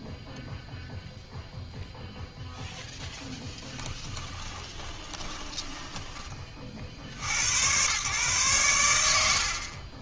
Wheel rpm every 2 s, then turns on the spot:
0, 0, 20, 50, 120.
4-6